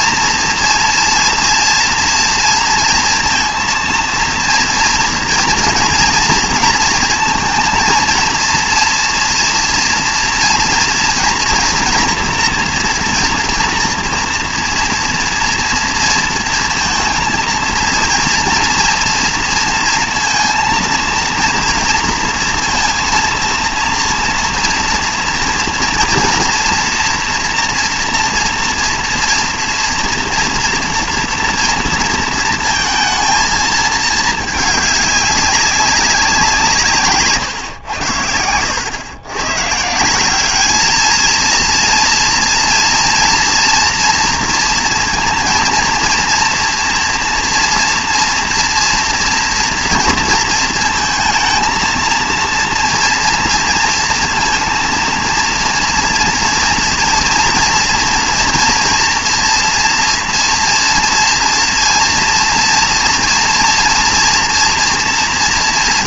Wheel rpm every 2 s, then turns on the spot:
230, 230, 230, 230, 230, 230, 230, 230, 230, 230, 230, 230, 230, 230, 230, 230, 220, 220, 180, 90, 210, 230, 230, 230, 230, 230, 230, 230, 230, 230, 230, 230, 240.
none